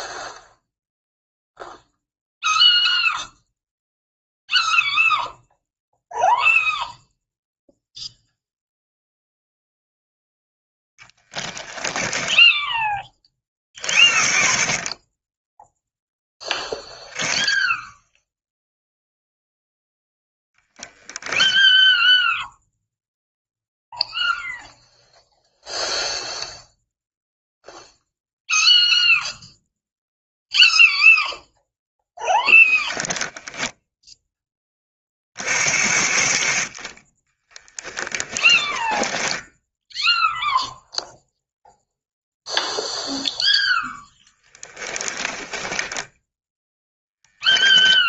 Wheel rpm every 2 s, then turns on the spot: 0, 0, 0, 0, 0, 0, 20, 30, 0, 0, 0, 0, 0, 0, 0, 0, 0, 30, 30, 20, 0, 0, 10, 0.
38-40 44-46